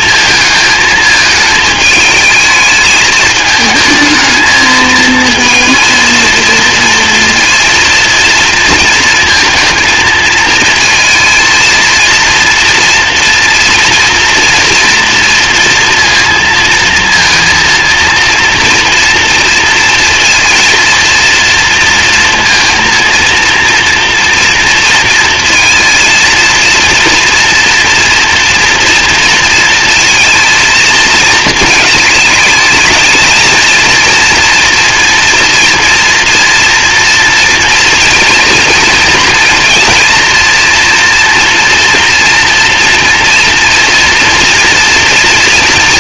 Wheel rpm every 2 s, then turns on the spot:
220, 220, 230, 230, 230, 230, 230, 230, 230, 230, 230, 230, 230, 230, 230, 220, 220, 230, 240, 230, 230, 230, 230.
none